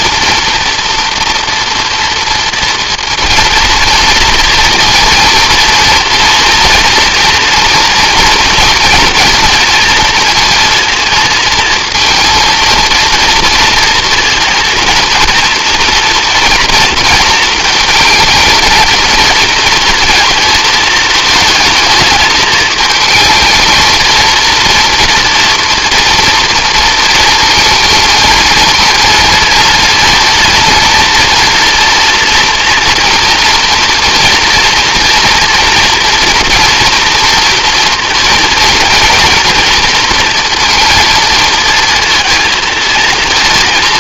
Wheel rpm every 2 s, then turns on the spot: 230, 230, 220, 230, 230, 230, 230, 230, 230, 230, 220, 220, 230, 230, 230, 230, 230, 230, 230, 230, 230, 190.
none